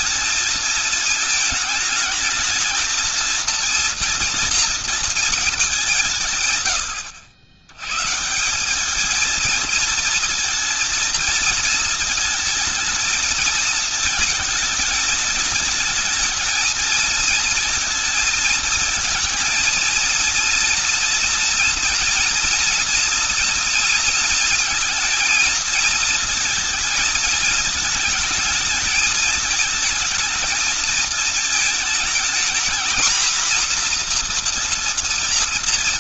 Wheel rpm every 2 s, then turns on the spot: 210, 220, 230, 120, 210, 230, 220, 220, 220, 220, 230, 240, 230, 220, 220, 220, 230, 230.
none